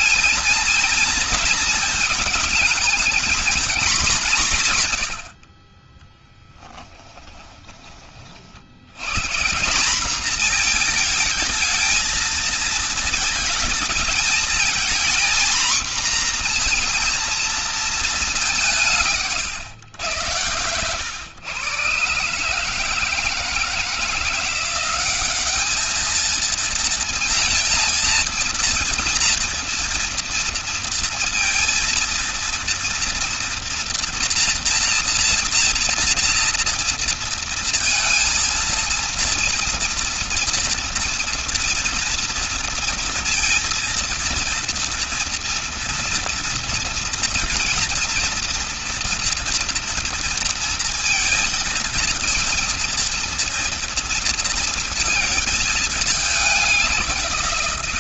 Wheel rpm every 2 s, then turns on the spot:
230, 220, 160, 10, 80, 220, 220, 230, 240, 180, 100, 150, 190, 230, 230, 230, 230, 230, 230, 230, 230, 230, 230, 230, 240, 230, 230, 230, 200.
6-8